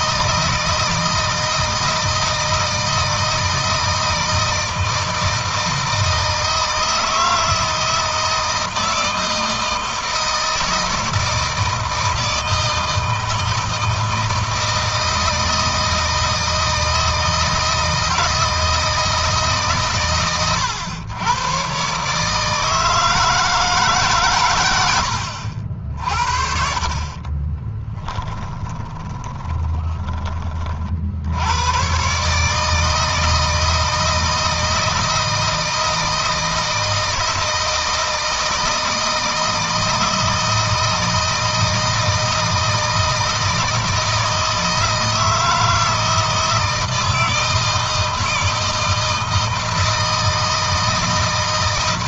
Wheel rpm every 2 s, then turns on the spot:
170, 160, 160, 160, 160, 160, 160, 160, 160, 160, 100, 160, 90, 50, 20, 50, 150, 160, 160, 160, 160, 160, 160, 160, 160, 160.
24-30